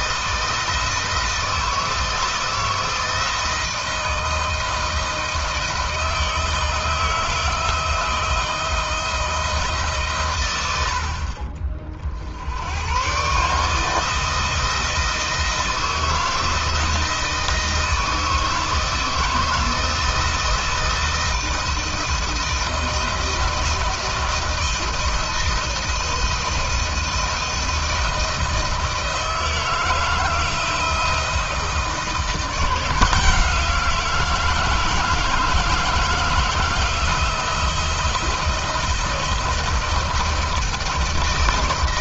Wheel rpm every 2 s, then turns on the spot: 160, 160, 160, 160, 170, 100, 90, 160, 160, 160, 160, 170, 170, 160, 160, 160, 170, 170, 160, 160, 160.
none